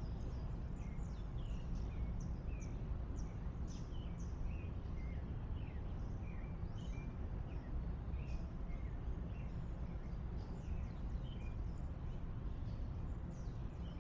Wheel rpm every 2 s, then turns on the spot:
0, 0, 0, 0, 0, 0, 0.
none